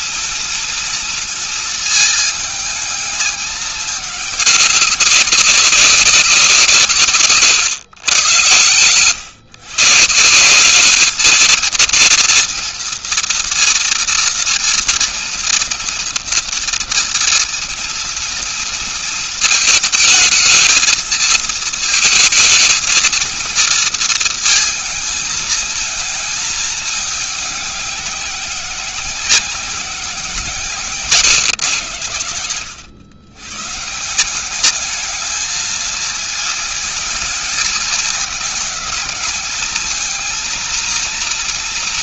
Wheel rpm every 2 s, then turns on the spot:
230, 220, 200, 150, 110, 200, 230, 230, 230, 230, 230, 220, 220, 220, 190, 160, 110, 210, 220, 210, 230.
none